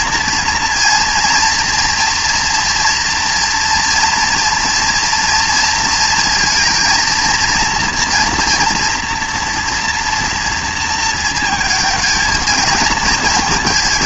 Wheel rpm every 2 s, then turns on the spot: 230, 240, 230, 230, 240, 230, 220.
none